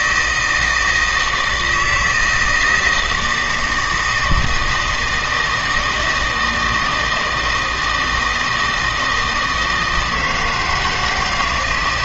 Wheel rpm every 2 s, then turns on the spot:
160, 160, 160, 160, 160, 170.
none